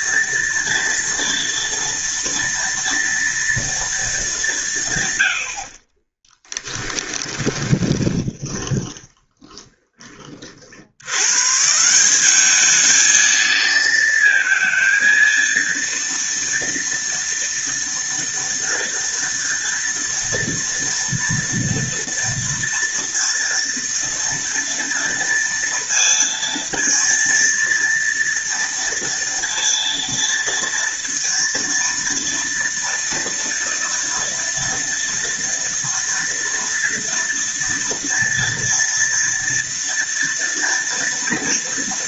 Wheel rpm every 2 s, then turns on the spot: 230, 230, 180, 30, 20, 50, 200, 230, 230, 230, 230, 230, 230, 230, 230, 230, 230, 230, 230, 230, 230.
6-10